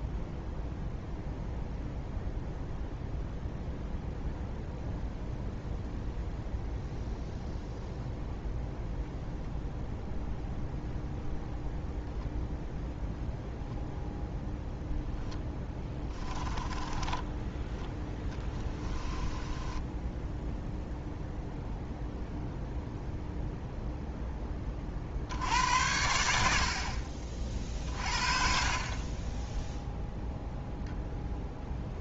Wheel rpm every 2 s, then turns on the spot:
0, 0, 0, 0, 0, 0, 0, 10, 30, 20, 0, 0, 50, 50, 40, 0.
14-20